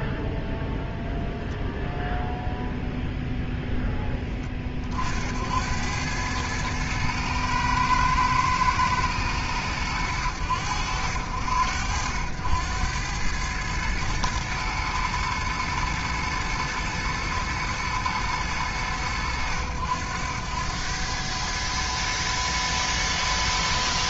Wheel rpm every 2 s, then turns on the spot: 0, 0, 40, 110, 110, 80, 90, 110, 120, 100, 100, 110.
none